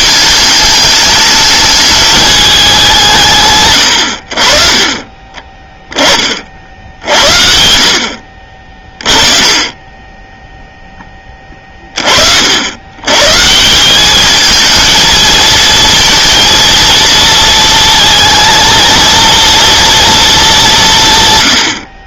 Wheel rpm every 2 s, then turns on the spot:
210, 210, 50, 50, 40, 10, 60, 220, 230, 230, 210.
none